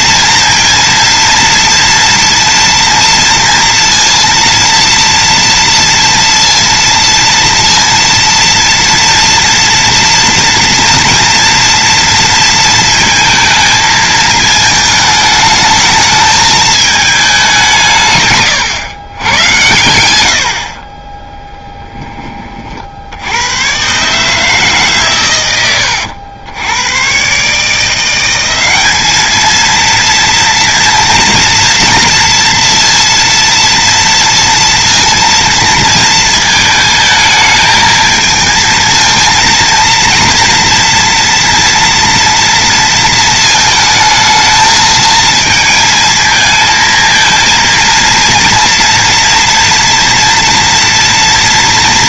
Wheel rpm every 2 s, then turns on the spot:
230, 230, 230, 230, 230, 230, 230, 220, 220, 120, 30, 60, 130, 100, 200, 230, 230, 230, 220, 220, 230, 230, 220, 230, 230, 230.
none